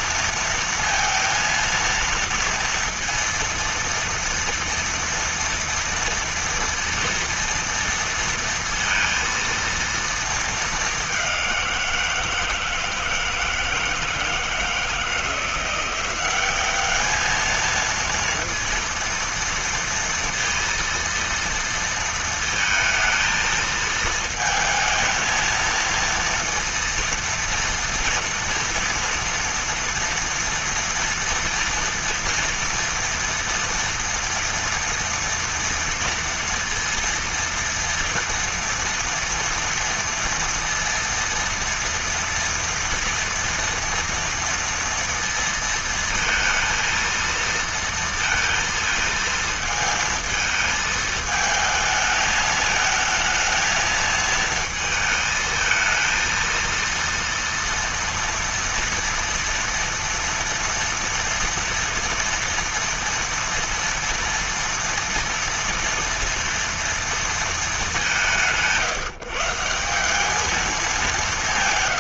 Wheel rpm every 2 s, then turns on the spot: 230, 230, 230, 230, 230, 230, 170, 170, 190, 230, 230, 230, 230, 230, 230, 230, 230, 230, 230, 230, 230, 230, 230, 230, 230, 220, 220, 220, 230, 230, 230, 230, 230, 230, 190, 190.
none